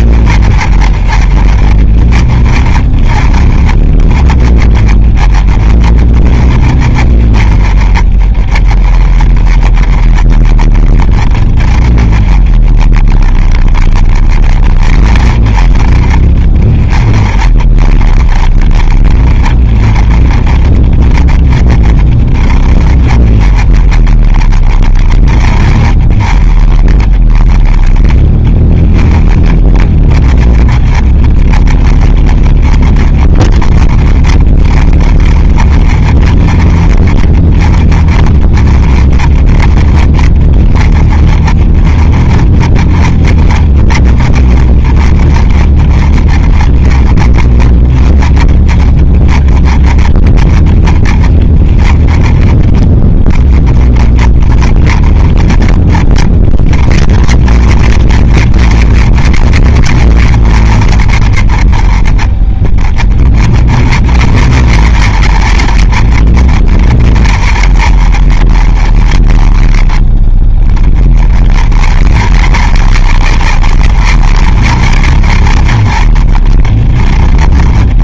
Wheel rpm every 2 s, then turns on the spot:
30, 30, 20, 30, 30, 30, 30, 30, 20, 20, 20, 20, 30, 30, 20, 20, 30, 30, 30, 30, 30, 30, 30, 30, 20, 30, 20, 30, 40, 50, 50, 30, 50, 40, 40, 20, 50, 50, 30.
none